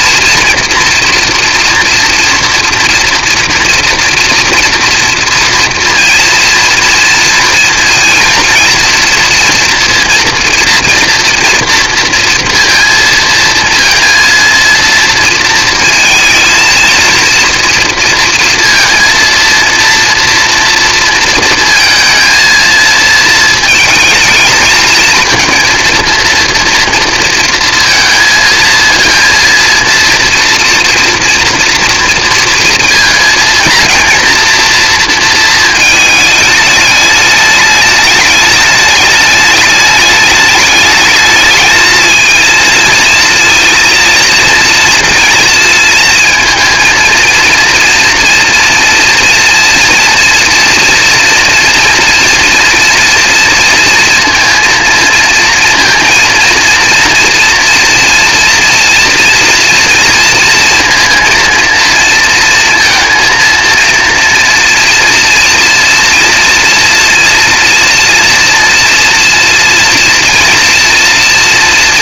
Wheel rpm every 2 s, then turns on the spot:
230, 230, 230, 230, 230, 230, 230, 230, 230, 230, 230, 230, 220, 230, 230, 230, 230, 230, 210, 210, 210, 230, 230, 230, 230, 230, 230, 230, 230, 230, 230, 230, 230, 230, 230, 240.
none